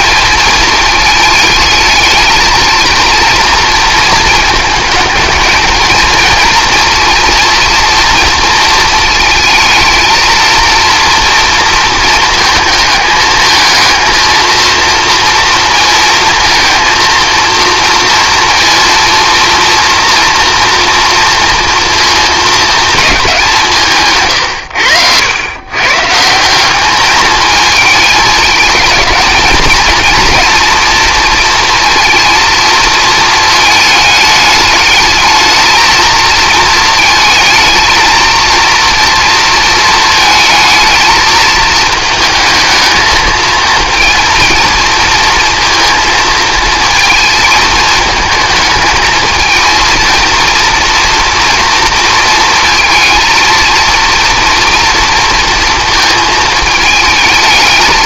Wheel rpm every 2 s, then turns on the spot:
220, 220, 220, 230, 230, 230, 220, 230, 230, 230, 240, 220, 100, 200, 220, 230, 230, 210, 220, 230, 220, 220, 230, 220, 220, 230, 230, 230, 220.
none